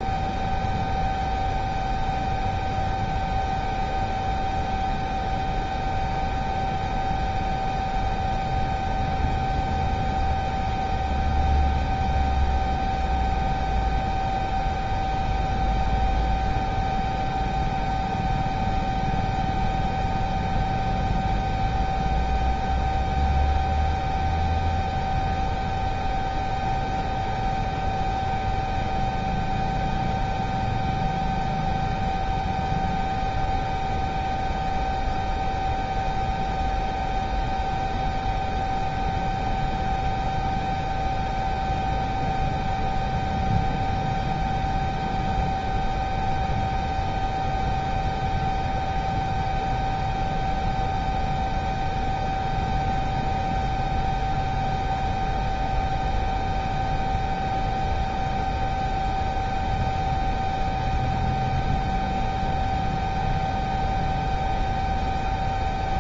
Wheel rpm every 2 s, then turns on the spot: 0, 0, 0, 0, 0, 0, 0, 0, 0, 0, 0, 0, 0, 0, 0, 0, 0, 0, 0, 0, 0, 0, 0, 0, 0, 0, 0, 0, 0, 0, 0, 0, 0.
none